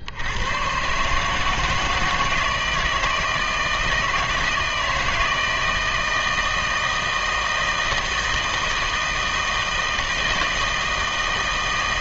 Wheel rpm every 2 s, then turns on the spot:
120, 160, 160, 160, 160, 160.
none